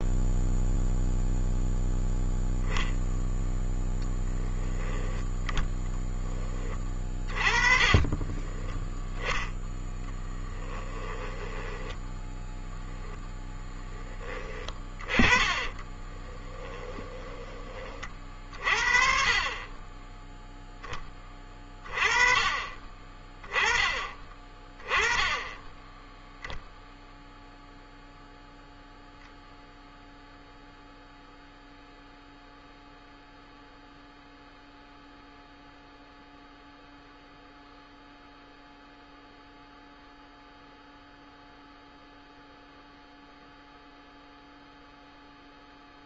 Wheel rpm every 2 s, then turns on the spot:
0, 0, 10, 20, 0, 10, 0, 20, 10, 40, 10, 20, 20, 0, 0, 0, 0, 0, 0, 0, 0, 0, 0.
6-8 10-12 14-18